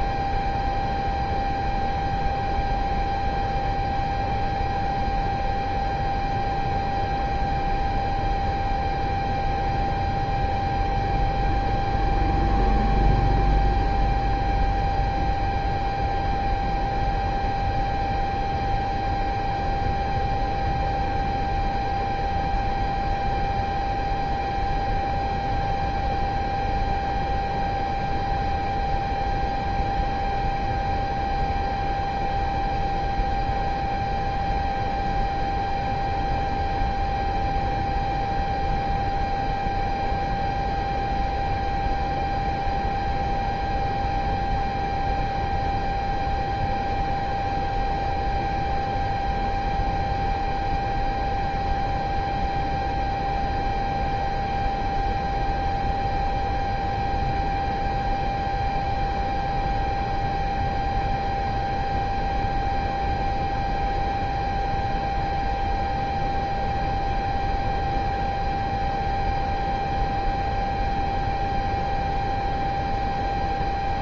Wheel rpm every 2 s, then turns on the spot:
0, 0, 0, 0, 0, 0, 0, 0, 0, 0, 0, 0, 0, 0, 0, 0, 0, 0, 0, 0, 0, 0, 0, 0, 0, 0, 0, 0, 0, 0, 0, 0, 0, 0, 0, 0, 0.
none